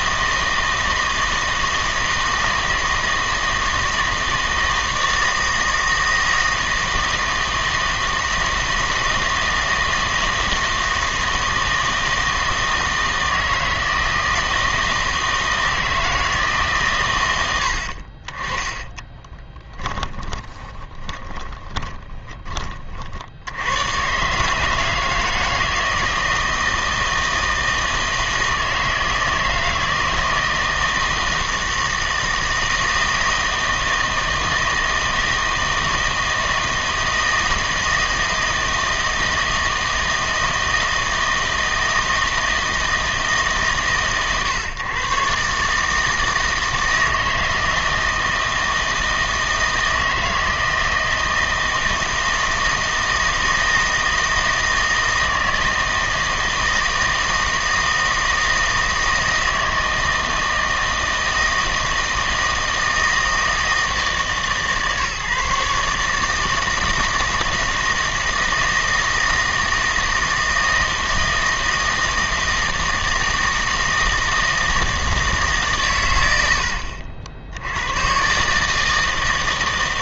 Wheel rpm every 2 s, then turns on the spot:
160, 160, 160, 160, 160, 160, 160, 160, 140, 20, 20, 40, 160, 160, 160, 160, 160, 160, 160, 160, 160, 160, 130, 160, 160, 160, 160, 160, 160, 160, 160, 160, 150, 160, 160, 160, 160, 160, 80, 160.
18-22